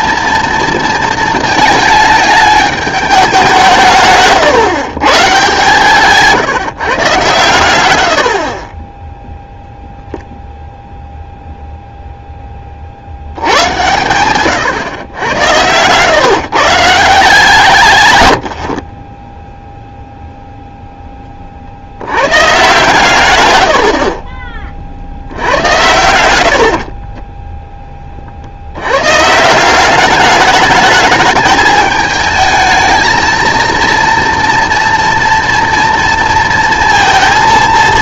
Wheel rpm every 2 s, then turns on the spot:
230, 210, 130, 140, 20, 0, 20, 130, 160, 50, 0, 130, 30, 70, 90, 210, 220, 240, 230.
none